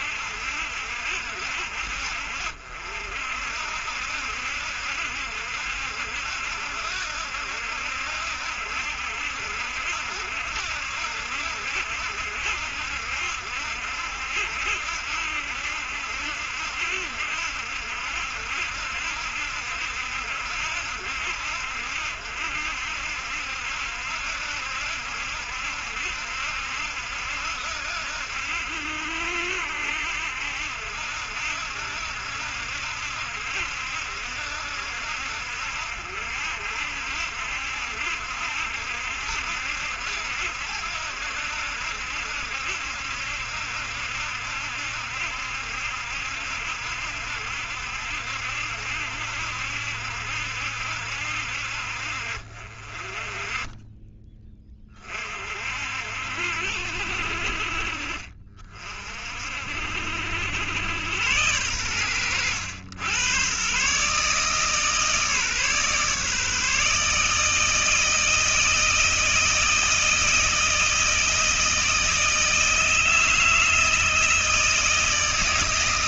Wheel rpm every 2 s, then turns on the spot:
60, 60, 70, 70, 70, 70, 70, 70, 70, 70, 70, 70, 70, 70, 70, 70, 70, 70, 60, 70, 70, 70, 70, 70, 70, 70, 50, 20, 70, 40, 80, 100, 150, 150, 160, 160, 160, 160.
none